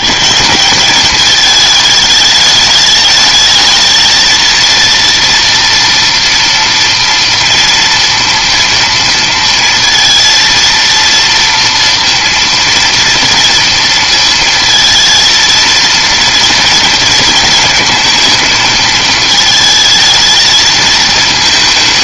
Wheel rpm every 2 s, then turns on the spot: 190, 210, 230, 230, 230, 230, 230, 230, 230, 220, 220.
none